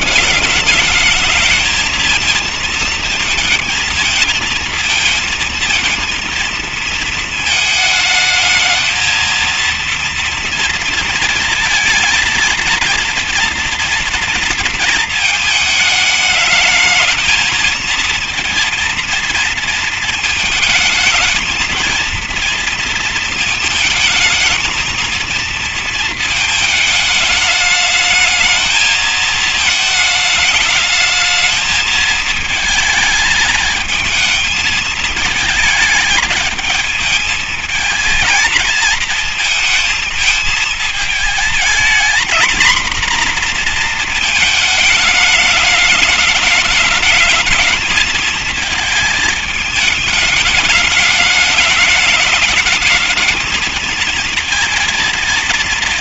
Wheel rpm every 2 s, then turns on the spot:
210, 230, 230, 220, 220, 230, 220, 220, 210, 230, 230, 230, 230, 220, 220, 220, 220, 220, 220, 220, 220, 240, 220, 210, 220, 210, 210, 230.
none